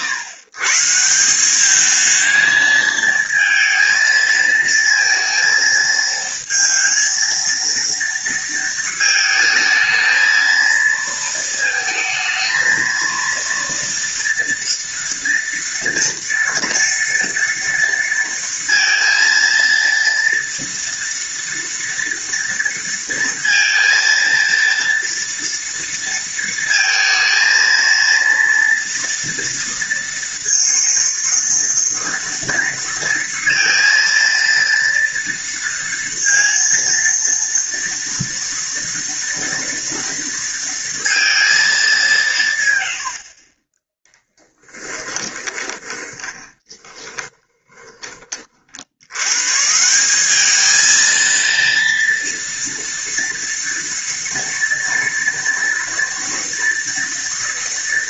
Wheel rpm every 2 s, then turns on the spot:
130, 220, 220, 230, 230, 230, 230, 230, 230, 230, 230, 230, 230, 230, 230, 230, 230, 230, 230, 230, 230, 120, 10, 20, 50, 210, 230, 230, 230.
44-48